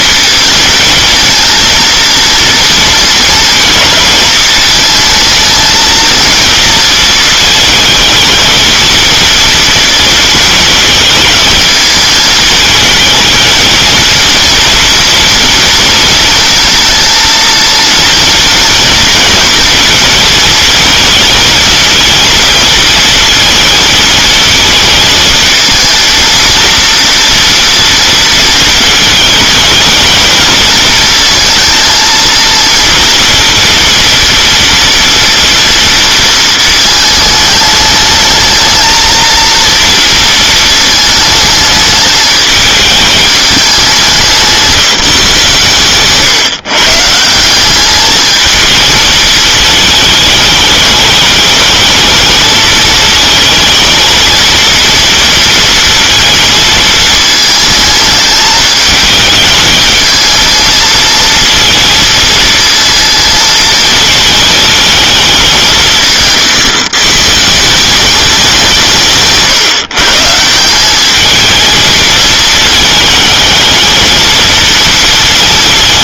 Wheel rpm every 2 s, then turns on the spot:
230, 230, 230, 230, 230, 220, 220, 230, 230, 230, 220, 230, 220, 230, 220, 230, 230, 240, 220, 220, 220, 220, 170, 150, 220, 210, 220, 230, 220, 210, 230, 230, 220, 120, 160, 200, 220, 230.
none